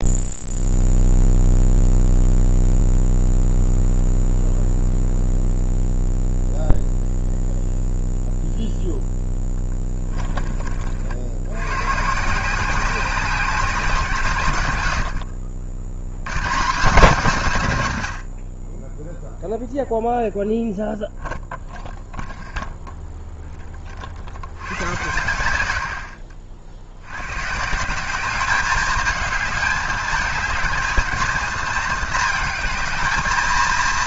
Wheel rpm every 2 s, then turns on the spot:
0, 0, 0, 0, 0, 40, 180, 120, 170, 40, 0, 0, 100, 60, 210, 220, 220.
none